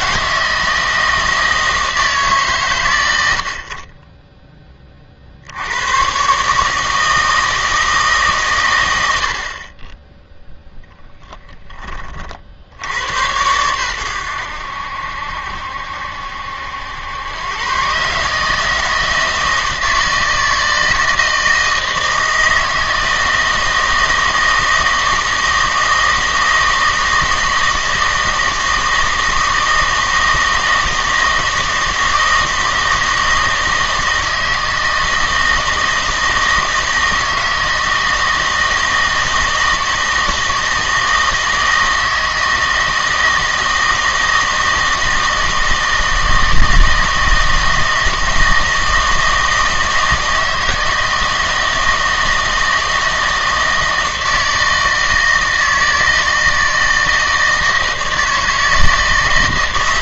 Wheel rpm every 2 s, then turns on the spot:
160, 140, 20, 150, 120, 10, 80, 80, 80, 160, 160, 160, 160, 160, 160, 160, 160, 160, 160, 160, 160, 160, 160, 160, 160, 160, 160, 160, 160, 160.
none